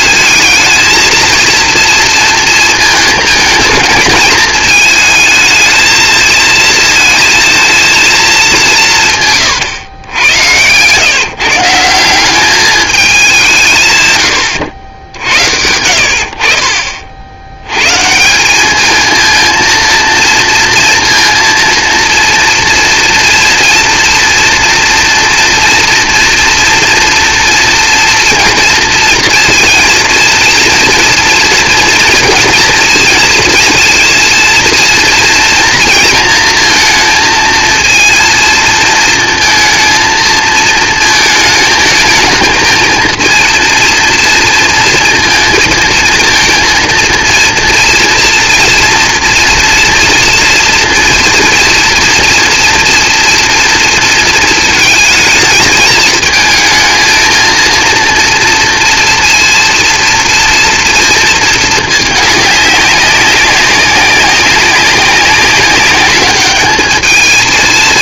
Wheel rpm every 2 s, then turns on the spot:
220, 220, 220, 230, 160, 130, 200, 70, 50, 220, 230, 230, 230, 230, 230, 230, 230, 230, 230, 230, 220, 230, 230, 230, 230, 230, 230, 220, 220, 230, 230, 200, 190, 220.
none